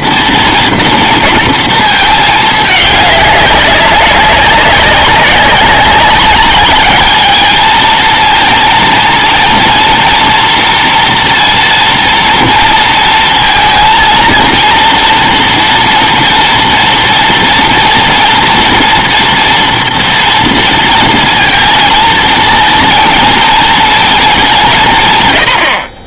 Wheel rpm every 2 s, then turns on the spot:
230, 210, 200, 200, 230, 230, 230, 230, 230, 230, 230, 230, 200.
none